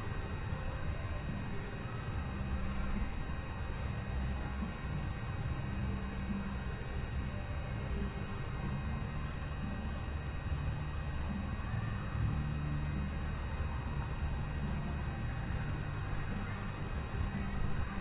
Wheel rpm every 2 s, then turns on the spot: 0, 0, 0, 0, 0, 0, 0, 0, 0.
none